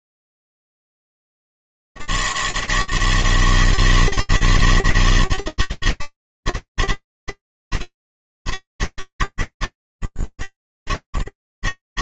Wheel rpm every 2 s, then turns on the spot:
80, 160, 160, 160, 130, 60.
none